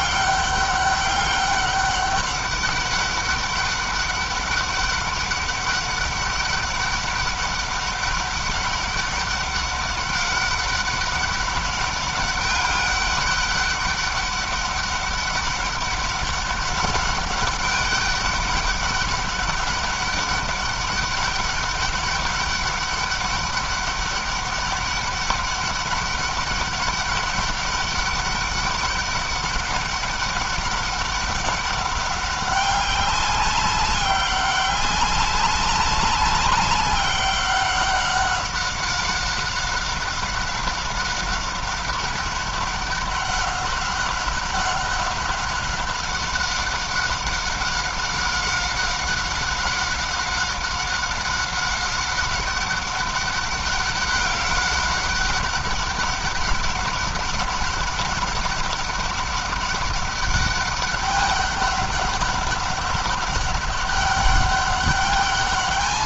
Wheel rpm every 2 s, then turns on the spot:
200, 200, 200, 200, 200, 200, 200, 200, 200, 200, 200, 200, 200, 200, 200, 200, 190, 200, 190, 190, 190, 200, 200, 190, 190, 190, 200, 200, 190, 200, 200, 200, 200.
none